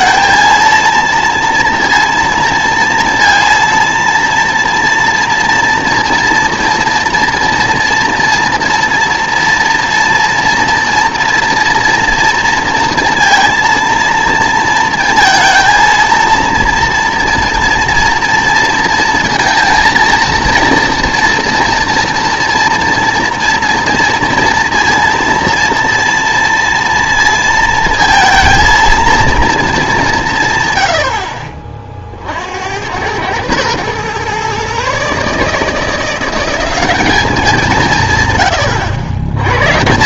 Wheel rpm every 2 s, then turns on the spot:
230, 230, 230, 230, 230, 230, 230, 230, 230, 230, 230, 230, 230, 230, 230, 110, 80, 130, 190, 100.
none